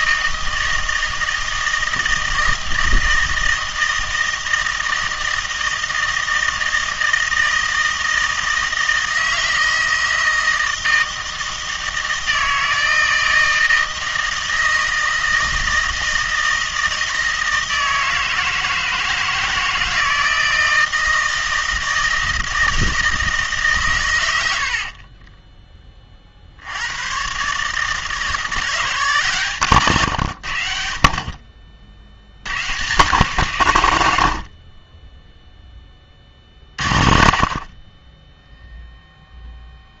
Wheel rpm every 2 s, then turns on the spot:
160, 160, 160, 160, 160, 160, 160, 160, 160, 160, 160, 160, 70, 60, 170, 70, 130, 50, 30, 0.
none